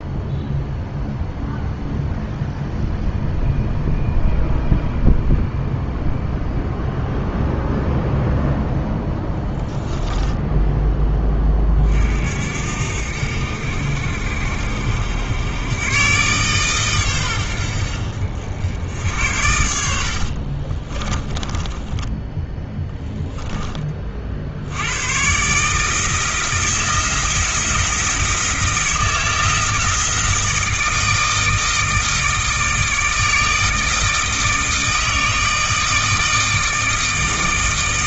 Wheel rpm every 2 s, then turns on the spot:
0, 0, 0, 0, 0, 10, 70, 70, 130, 70, 40, 10, 80, 160, 160, 160, 160, 160, 160.
20-24